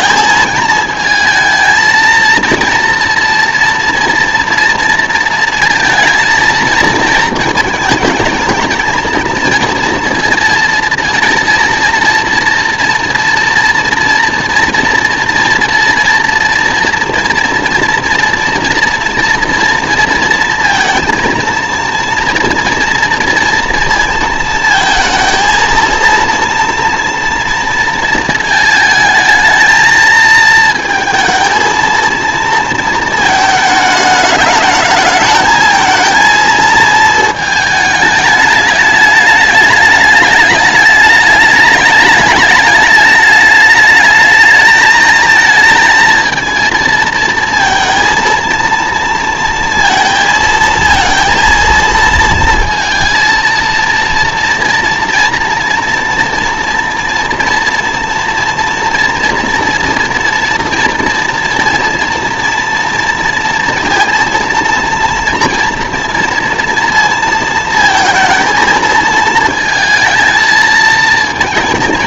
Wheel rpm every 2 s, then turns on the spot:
220, 230, 230, 230, 220, 230, 230, 230, 230, 230, 230, 230, 230, 230, 220, 220, 230, 210, 220, 210, 210, 210, 220, 230, 230, 230, 230, 240, 230, 230, 230, 230, 230, 230, 230, 220.
none